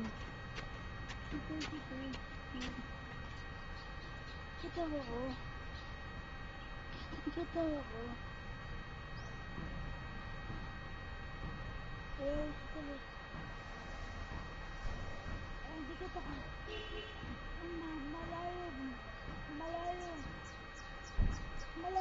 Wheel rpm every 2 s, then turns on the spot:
0, 0, 0, 0, 0, 0, 0, 0, 0, 0, 0.
none